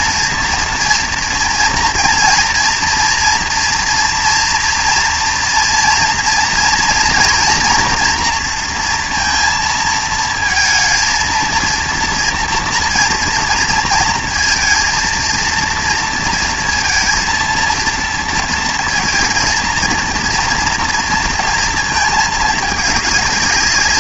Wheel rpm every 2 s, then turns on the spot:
230, 230, 230, 230, 230, 230, 230, 230, 230, 230, 230, 210.
none